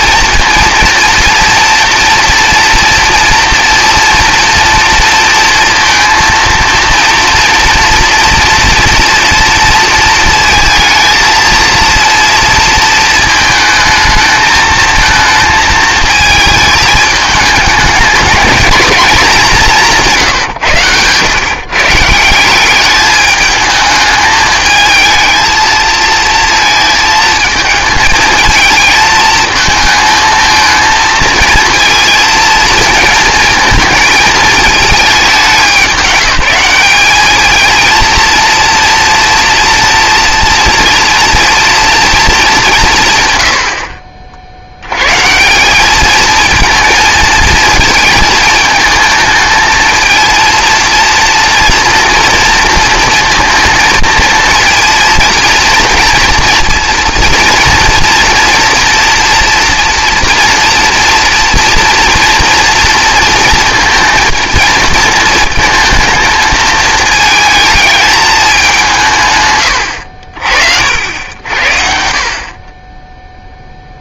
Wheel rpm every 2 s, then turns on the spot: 230, 230, 230, 230, 230, 230, 230, 220, 220, 230, 130, 190, 220, 220, 220, 230, 230, 220, 200, 230, 230, 200, 70, 220, 220, 230, 230, 230, 240, 230, 230, 230, 230, 220, 200, 60, 30.
none